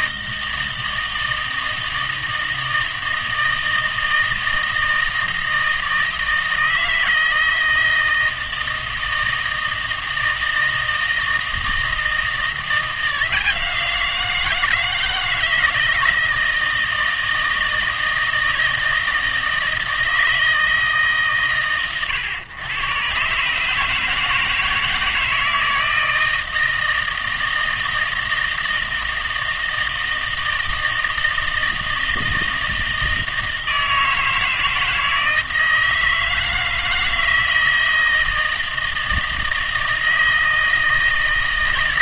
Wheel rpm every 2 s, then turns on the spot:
160, 160, 160, 160, 160, 160, 170, 160, 160, 160, 160, 110, 160, 160, 160, 160, 160, 160, 160, 160, 160.
none